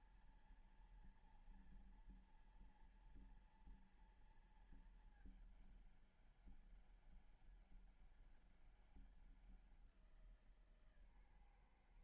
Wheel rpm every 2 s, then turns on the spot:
230, 230, 230, 200, 200, 160.
none